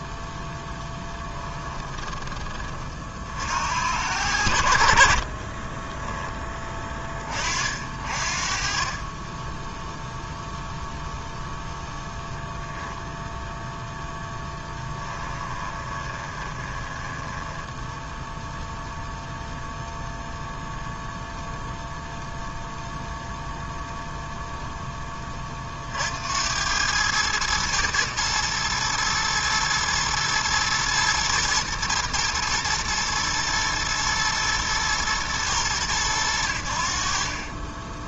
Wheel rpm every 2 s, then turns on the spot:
10, 20, 80, 20, 50, 0, 0, 10, 20, 0, 0, 0, 0, 80, 110, 110, 110, 120, 80.
0-2 14-18